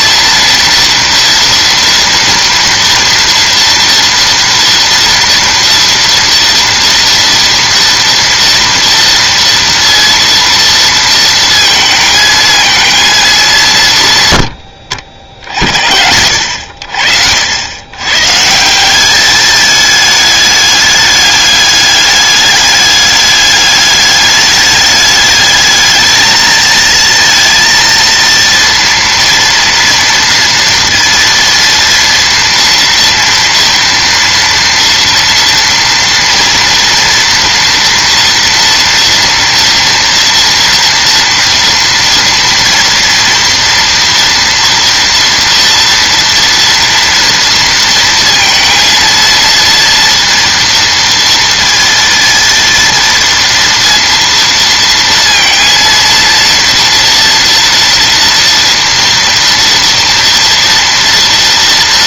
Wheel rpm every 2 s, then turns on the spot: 240, 230, 230, 230, 230, 230, 220, 70, 60, 180, 210, 210, 210, 220, 230, 230, 230, 230, 230, 230, 230, 230, 230, 230, 230, 230, 230, 230, 230, 240, 230.
none